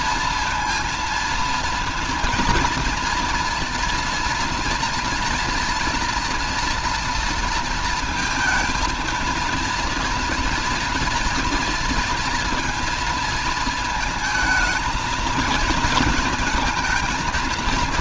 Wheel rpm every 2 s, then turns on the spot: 230, 230, 230, 230, 220, 240, 230, 220, 230.
none